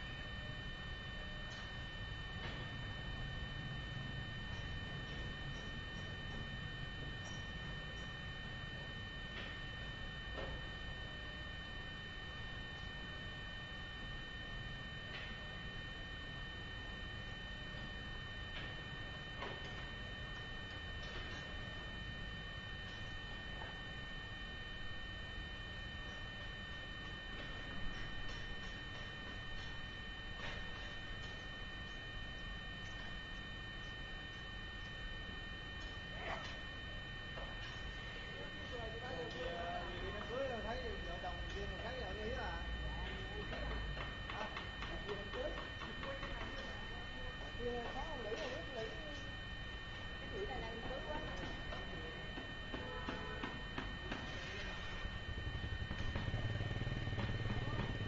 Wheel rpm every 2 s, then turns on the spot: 0, 0, 0, 0, 0, 0, 0, 0, 0, 0, 0, 0, 0, 0, 0, 0, 0, 0, 0, 0, 0, 0, 0, 0, 0, 0, 0, 0, 0.
none